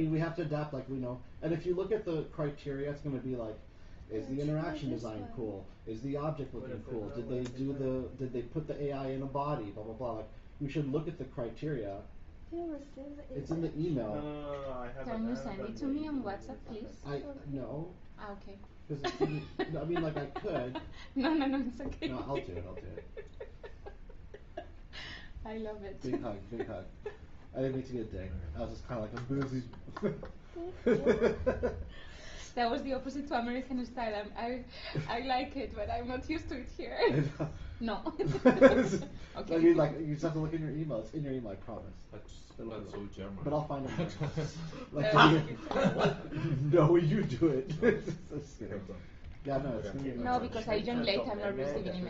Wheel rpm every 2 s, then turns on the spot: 0, 0, 0, 0, 0, 0, 0, 0, 0, 0, 0, 0, 0, 0, 0, 0, 0, 0, 0, 0, 0, 0, 0, 0, 0, 0.
none